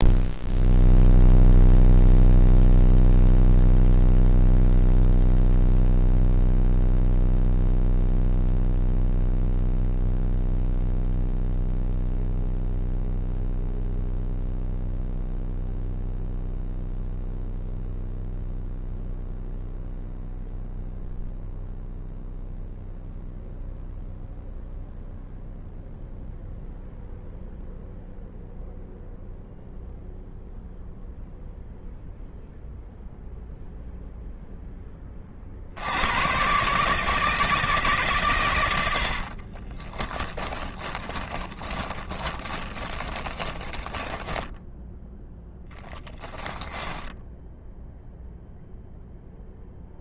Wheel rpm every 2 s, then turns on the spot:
0, 0, 0, 0, 0, 0, 0, 0, 0, 0, 0, 0, 0, 0, 0, 0, 0, 20, 150, 60, 10, 20, 0, 0, 0.
38-44